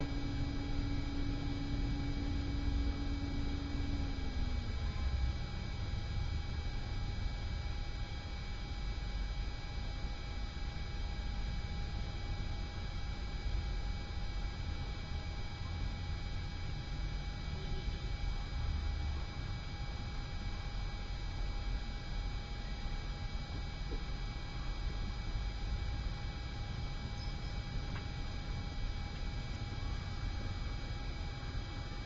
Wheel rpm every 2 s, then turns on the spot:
0, 0, 0, 0, 0, 0, 0, 0, 0, 0, 0, 0, 0, 0, 0, 0.
none